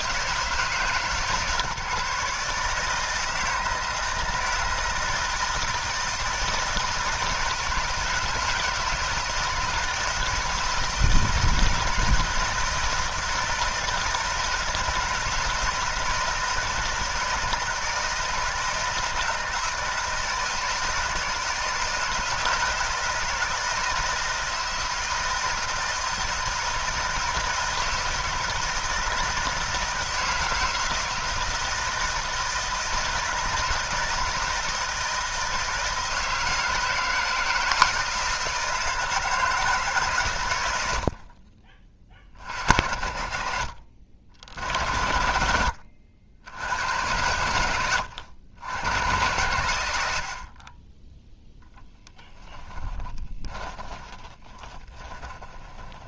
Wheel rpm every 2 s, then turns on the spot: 160, 160, 160, 160, 160, 160, 160, 160, 160, 160, 160, 160, 170, 160, 160, 160, 160, 160, 160, 160, 80, 40, 60, 90, 100, 20, 20, 20.
52-56